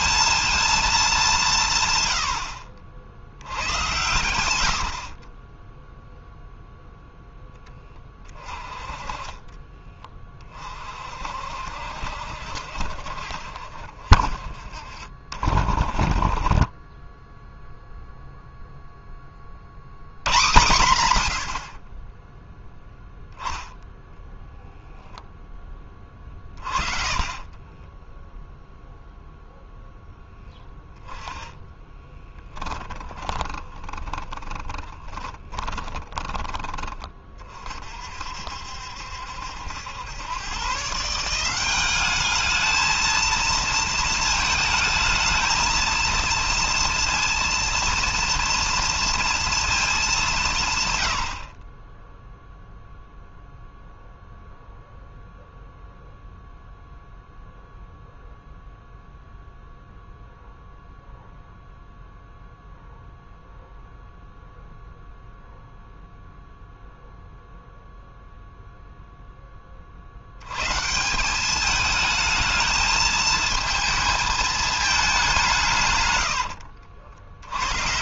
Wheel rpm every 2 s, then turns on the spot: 200, 70, 60, 0, 30, 50, 60, 50, 20, 10, 110, 0, 0, 40, 0, 10, 20, 20, 30, 70, 160, 220, 220, 230, 230, 110, 0, 0, 0, 0, 0, 0, 0, 0, 0, 160, 220, 200, 80.
4-6 26-28 30-36